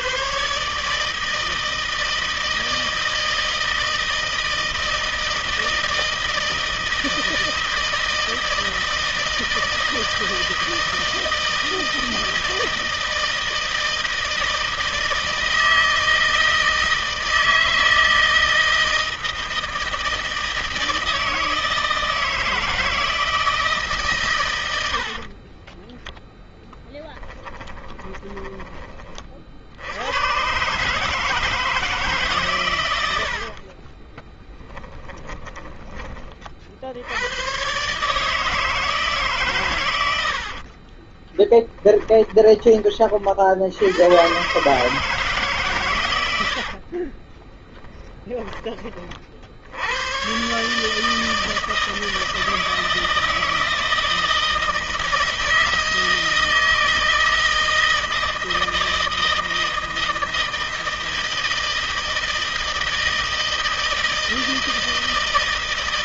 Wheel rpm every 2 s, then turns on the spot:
130, 160, 160, 160, 160, 160, 160, 160, 160, 160, 160, 160, 140, 10, 10, 100, 150, 20, 20, 140, 100, 20, 100, 110, 20, 100, 160, 160, 160, 160, 160, 160, 160.
26-30 34-36 40-44 48-50